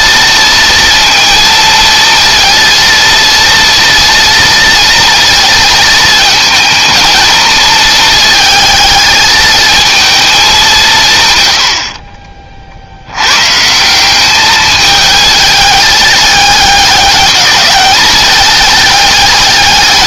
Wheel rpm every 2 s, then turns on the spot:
230, 230, 230, 220, 220, 140, 110, 220, 210, 210.
none